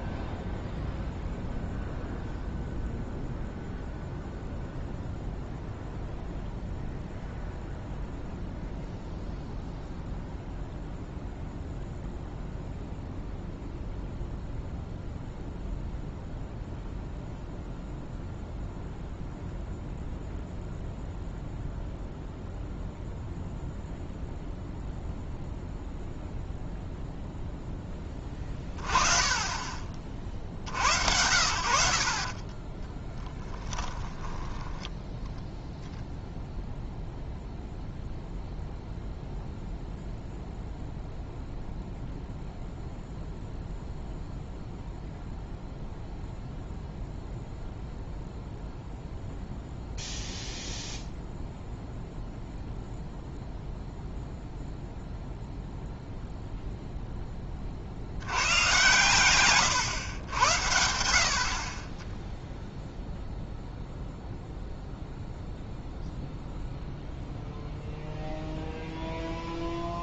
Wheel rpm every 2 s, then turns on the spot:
0, 0, 0, 0, 0, 0, 0, 0, 0, 0, 0, 0, 0, 0, 20, 70, 20, 10, 0, 0, 0, 0, 0, 0, 0, 0, 0, 0, 0, 120, 80, 0, 0, 0, 0.
32-34